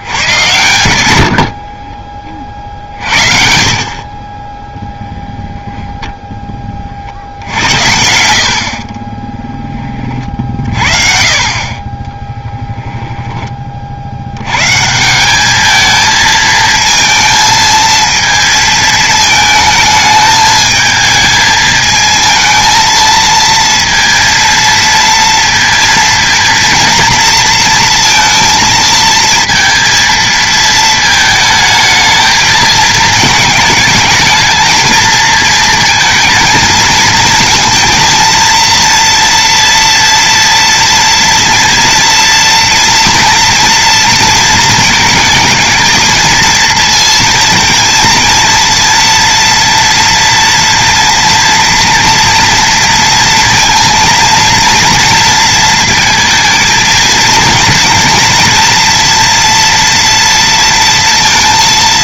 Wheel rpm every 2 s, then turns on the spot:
100, 50, 10, 30, 50, 50, 10, 150, 220, 220, 220, 230, 230, 230, 230, 220, 220, 230, 220, 230, 230, 230, 220, 230, 230, 230, 230, 230, 230, 230, 230.
8-10